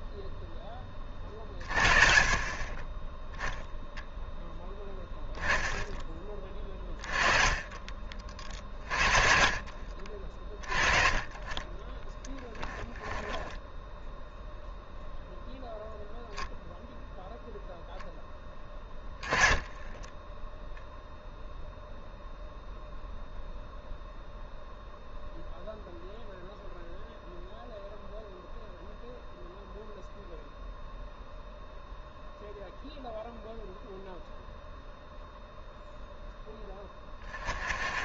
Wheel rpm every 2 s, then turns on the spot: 20, 20, 10, 20, 50, 30, 10, 0, 0, 10, 0, 0, 0, 0, 0, 0, 0, 0, 10.
12-14